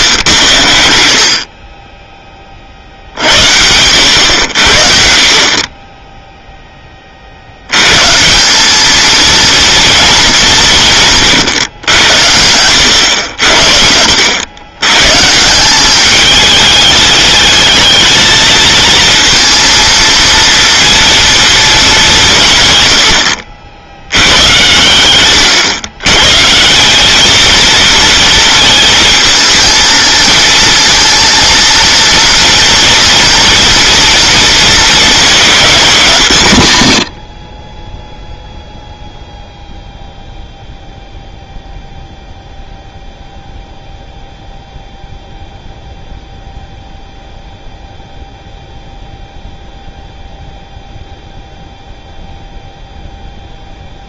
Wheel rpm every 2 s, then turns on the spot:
100, 30, 80, 10, 190, 200, 90, 100, 220, 230, 230, 130, 110, 150, 230, 230, 230, 230, 150, 0, 0, 0, 0, 0, 0, 0, 0.
none